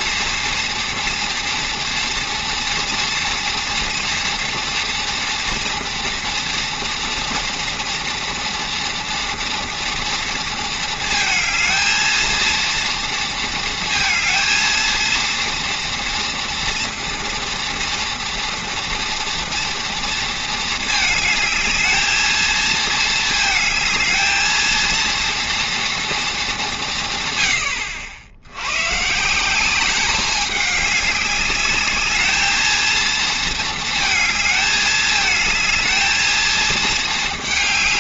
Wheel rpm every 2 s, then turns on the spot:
230, 230, 230, 230, 230, 220, 230, 230, 230, 230, 220, 220, 230, 200, 100, 200, 220, 220, 220.
none